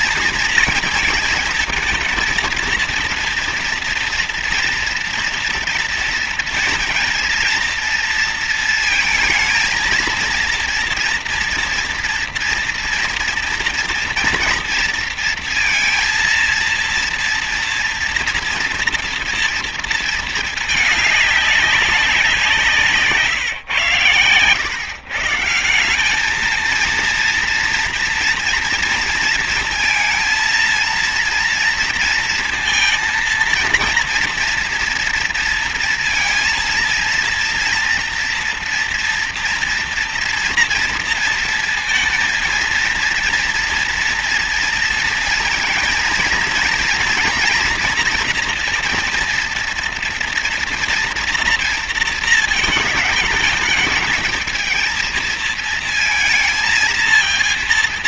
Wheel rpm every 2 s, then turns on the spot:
230, 220, 230, 230, 230, 230, 230, 230, 230, 230, 220, 180, 120, 200, 230, 230, 230, 230, 230, 240, 230, 230, 230, 230, 230, 230, 220, 220, 230.
none